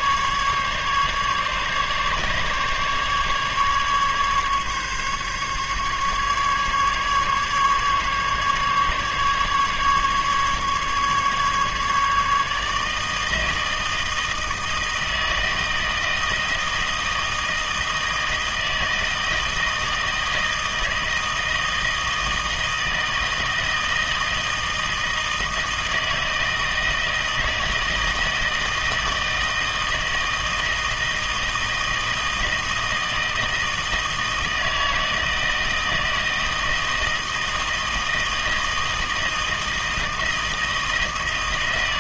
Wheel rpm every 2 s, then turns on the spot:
150, 140, 140, 150, 150, 150, 160, 160, 160, 160, 160, 160, 160, 160, 160, 160, 160, 160, 160, 160, 160.
none